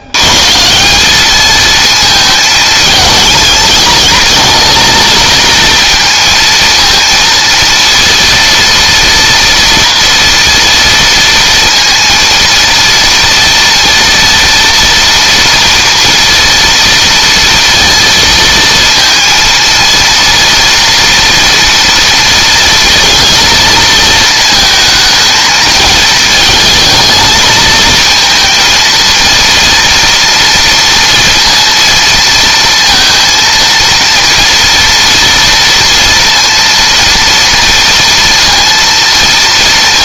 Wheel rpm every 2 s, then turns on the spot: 180, 220, 230, 230, 230, 230, 230, 230, 230, 230, 230, 230, 220, 220, 230, 230, 230, 230, 230, 230.
none